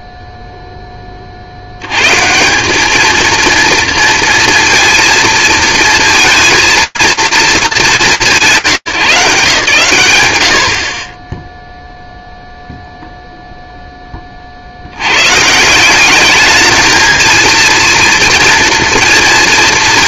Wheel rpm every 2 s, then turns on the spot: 0, 190, 230, 230, 150, 90, 0, 60, 210, 230.
none